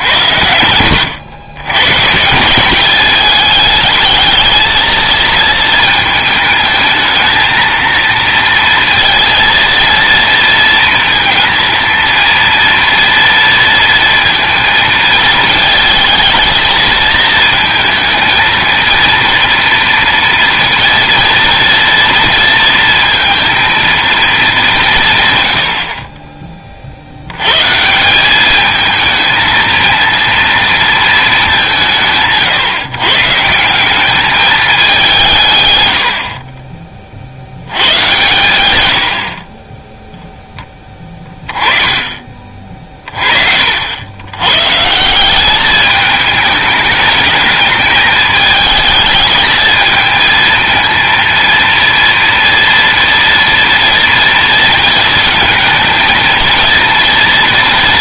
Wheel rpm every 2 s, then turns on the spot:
90, 200, 220, 220, 230, 230, 230, 220, 220, 230, 230, 230, 180, 50, 220, 230, 130, 200, 40, 100, 10, 40, 150, 210, 210, 220, 230, 220, 230.
0-2 38-40